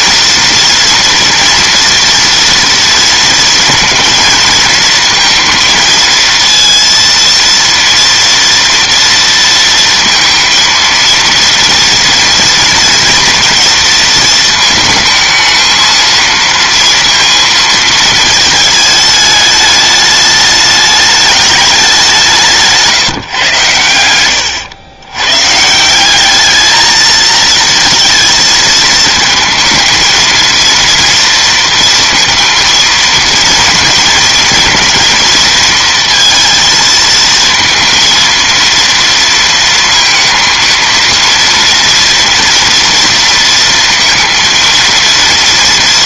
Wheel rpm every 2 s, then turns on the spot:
230, 230, 230, 230, 230, 230, 230, 220, 230, 220, 210, 160, 100, 220, 230, 230, 230, 230, 230, 230, 230, 240, 230.
none